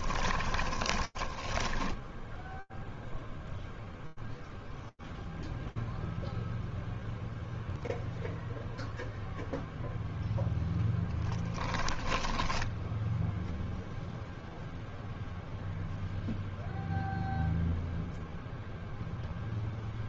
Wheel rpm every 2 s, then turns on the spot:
0, 0, 0, 0, 0, 10, 0, 0, 0, 0.
10-12